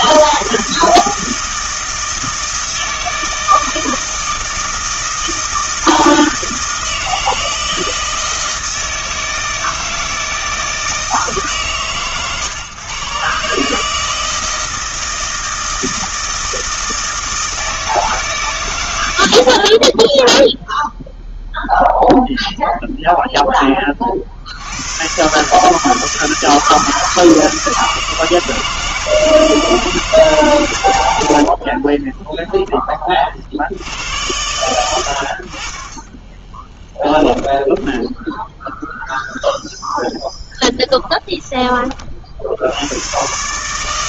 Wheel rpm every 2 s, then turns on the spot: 160, 160, 160, 160, 170, 160, 120, 160, 160, 130, 0, 0, 70, 160, 160, 130, 10, 90, 10, 0, 0, 80.
32-34 36-38